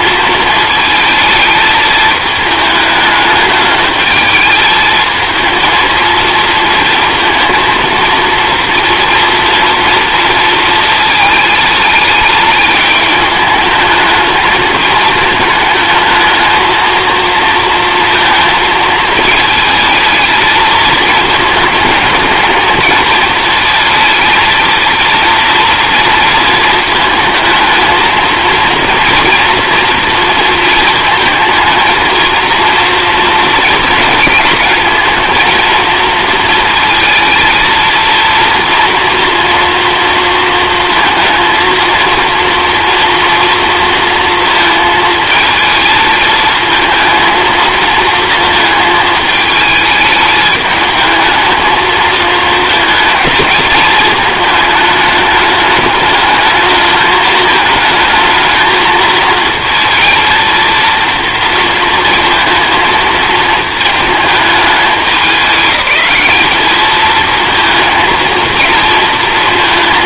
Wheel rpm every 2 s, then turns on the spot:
220, 210, 220, 230, 230, 230, 210, 220, 220, 220, 220, 220, 230, 220, 230, 230, 230, 230, 230, 230, 230, 230, 230, 220, 220, 220, 220, 220, 210, 220, 230, 220, 210, 210, 230.
none